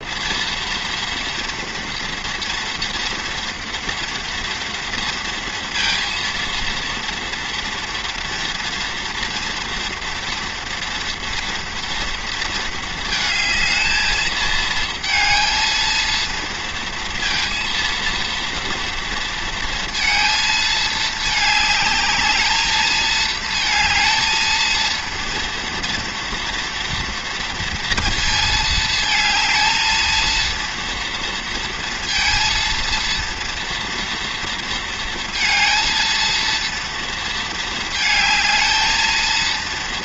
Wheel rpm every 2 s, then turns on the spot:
230, 230, 230, 230, 240, 230, 230, 220, 230, 230, 220, 220, 230, 240, 220, 230, 230, 230, 230, 220.
none